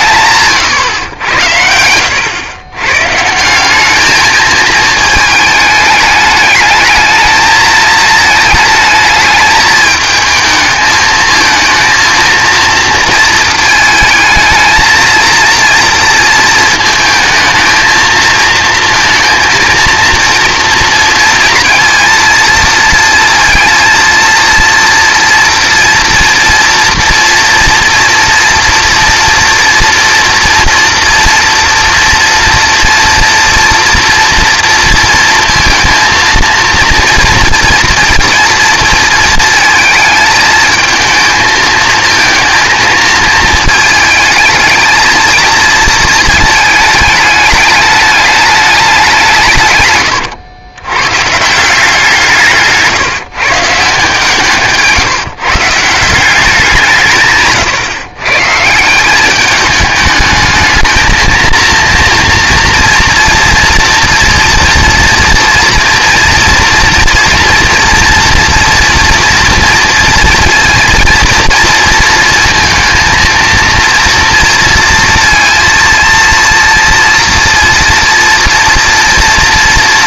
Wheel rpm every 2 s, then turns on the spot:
150, 100, 220, 210, 220, 220, 230, 220, 230, 230, 230, 230, 230, 230, 230, 230, 230, 240, 230, 230, 220, 230, 220, 220, 210, 110, 160, 160, 190, 150, 220, 230, 230, 230, 230, 230, 230, 230, 230, 230.
52-56